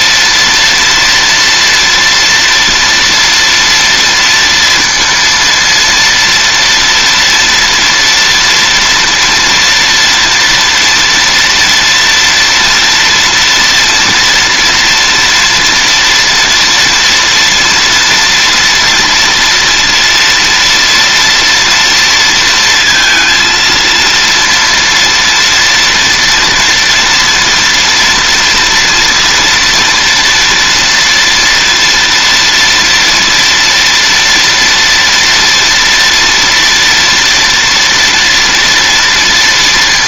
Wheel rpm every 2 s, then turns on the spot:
230, 230, 230, 230, 240, 240, 230, 230, 230, 230, 230, 230, 230, 230, 230, 230, 230, 230, 230, 230.
none